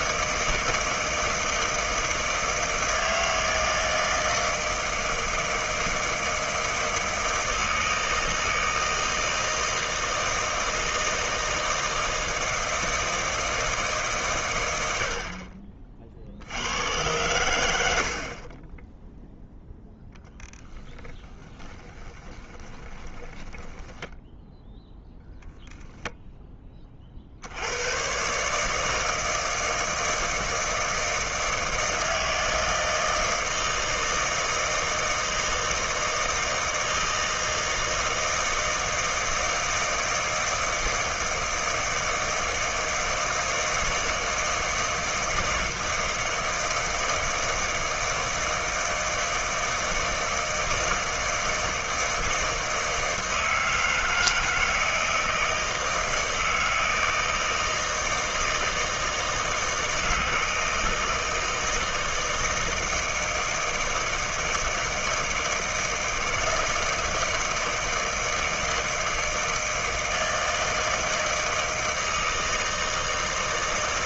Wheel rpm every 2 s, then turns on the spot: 160, 160, 160, 160, 160, 160, 160, 90, 100, 20, 10, 20, 0, 30, 160, 160, 160, 160, 160, 160, 160, 160, 160, 160, 160, 160, 160, 160, 160, 160, 160, 160, 160, 160, 160, 160, 160.
20-24